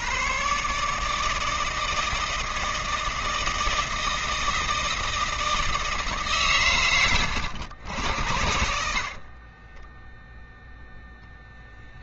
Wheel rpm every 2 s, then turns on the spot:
140, 160, 160, 120, 60, 0.
8-10